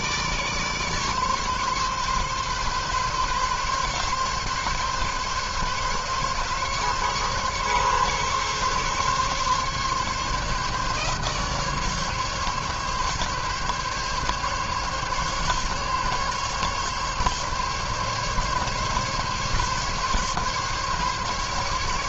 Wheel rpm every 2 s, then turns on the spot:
150, 140, 140, 140, 140, 140, 140, 140, 140, 140, 140.
none